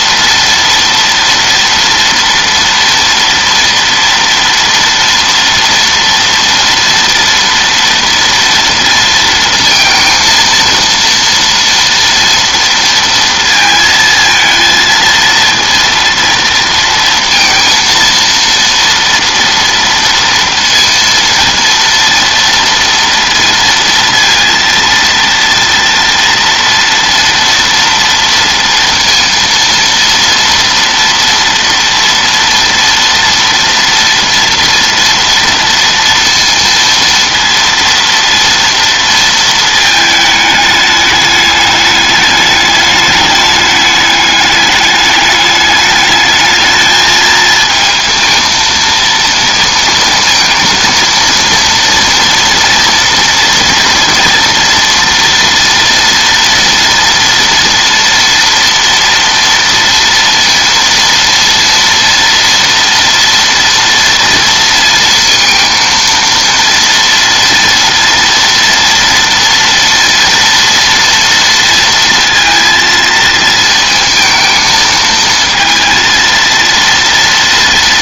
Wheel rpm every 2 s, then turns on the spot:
230, 230, 230, 230, 230, 230, 230, 220, 230, 230, 230, 230, 230, 230, 230, 230, 230, 230, 230, 230, 210, 210, 210, 220, 230, 230, 230, 230, 230, 230, 230, 240, 230, 230, 230, 230, 230, 220, 230.
none